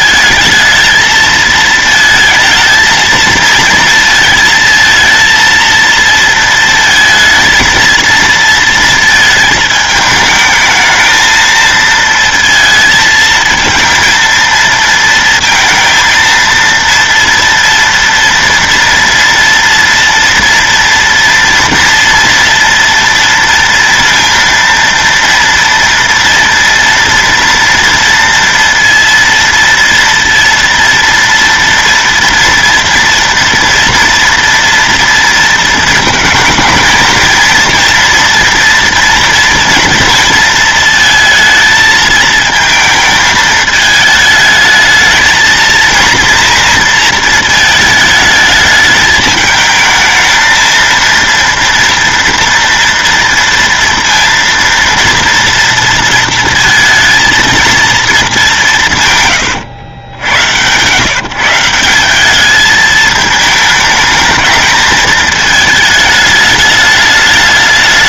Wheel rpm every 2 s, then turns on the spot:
220, 230, 230, 230, 230, 220, 230, 230, 230, 230, 230, 230, 230, 230, 230, 230, 230, 230, 220, 240, 230, 220, 220, 230, 220, 230, 230, 230, 230, 190, 110, 210, 220, 210.
none